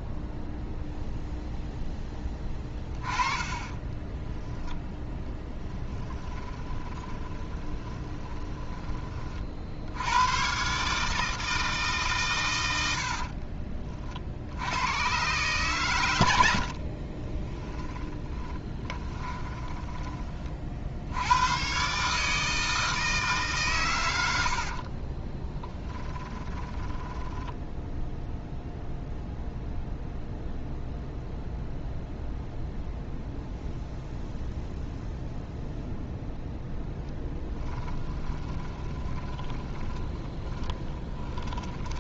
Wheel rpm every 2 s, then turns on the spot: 0, 20, 0, 30, 20, 150, 70, 80, 60, 20, 60, 160, 50, 10, 0, 0, 0, 0, 0, 20, 10.
6-8 16-20 24-28 38-42